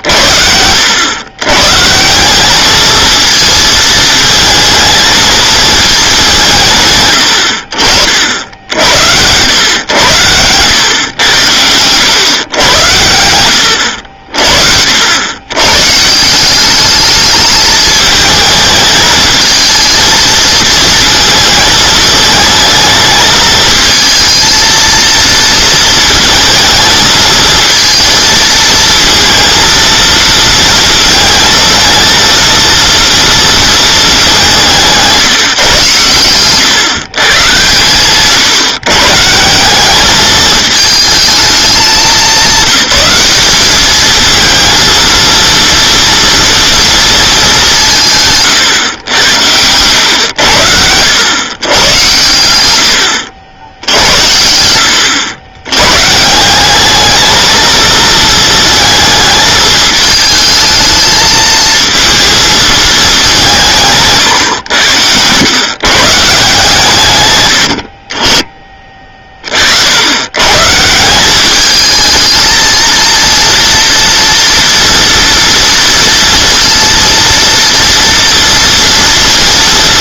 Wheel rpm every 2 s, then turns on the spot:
80, 210, 230, 150, 80, 110, 110, 60, 200, 220, 230, 220, 230, 220, 220, 230, 230, 190, 140, 140, 220, 200, 220, 230, 130, 90, 100, 80, 190, 220, 220, 220, 100, 150, 20, 140, 230, 230, 230, 230.
64-66